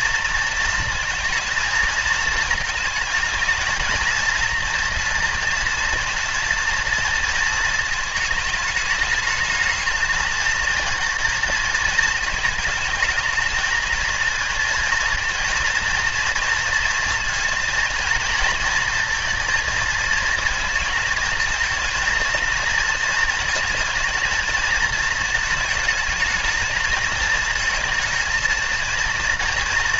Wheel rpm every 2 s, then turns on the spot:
230, 220, 230, 230, 210, 220, 220, 230, 230, 230, 220, 220, 220, 220, 230.
none